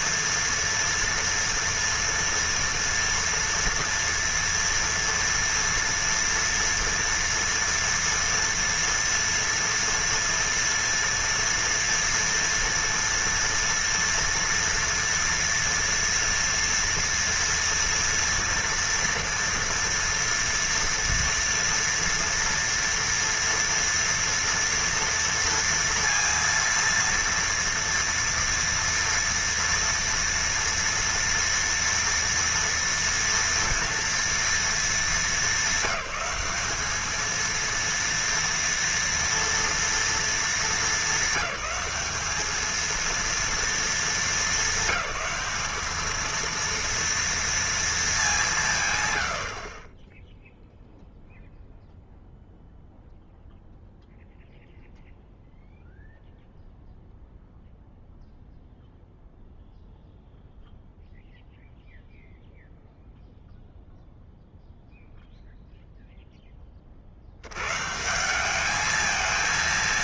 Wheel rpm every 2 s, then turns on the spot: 230, 230, 230, 230, 230, 230, 230, 230, 230, 240, 230, 230, 230, 230, 230, 230, 230, 230, 210, 230, 220, 220, 200, 230, 160, 0, 0, 0, 0, 0, 0, 0, 0, 10, 200.
none